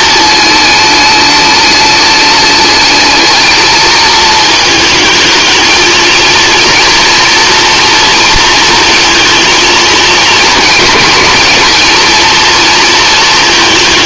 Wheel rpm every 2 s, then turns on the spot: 210, 210, 220, 230, 230, 220, 220.
none